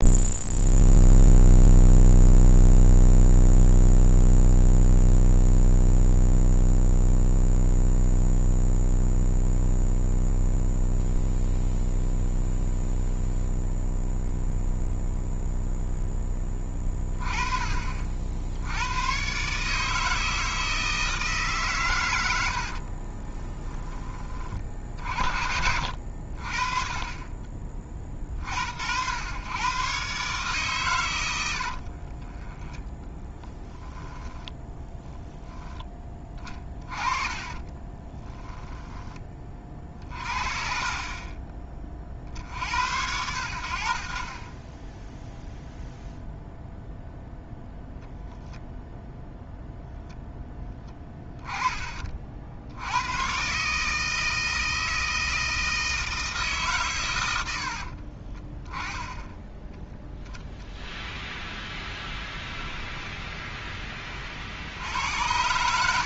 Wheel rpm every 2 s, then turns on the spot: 0, 0, 0, 0, 0, 0, 0, 0, 20, 110, 160, 40, 50, 40, 90, 120, 10, 10, 20, 10, 40, 80, 10, 0, 0, 10, 100, 160, 130, 10, 0, 10, 80.
22-24 32-34 36-38 62-64